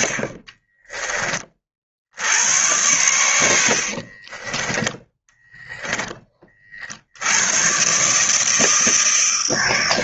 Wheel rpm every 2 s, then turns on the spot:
20, 90, 20, 60, 160.
4-6